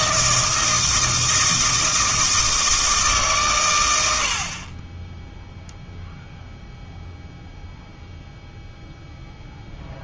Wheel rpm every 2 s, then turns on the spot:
160, 160, 30, 0, 0.
none